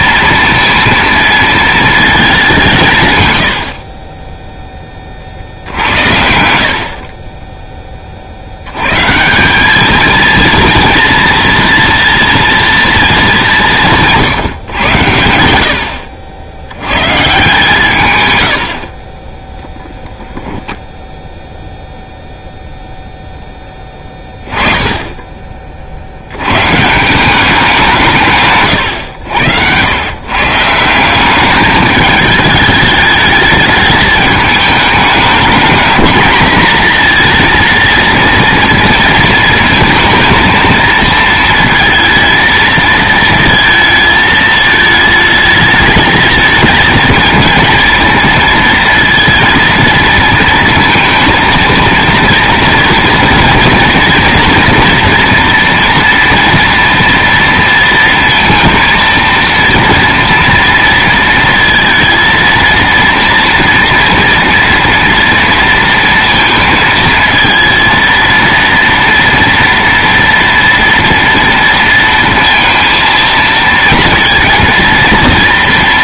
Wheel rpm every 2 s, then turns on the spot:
230, 170, 20, 60, 100, 230, 230, 120, 100, 70, 0, 0, 20, 130, 130, 160, 210, 220, 230, 230, 230, 230, 220, 220, 230, 230, 230, 240, 230, 230, 230, 230, 230, 220, 230, 230, 230, 230.
6-8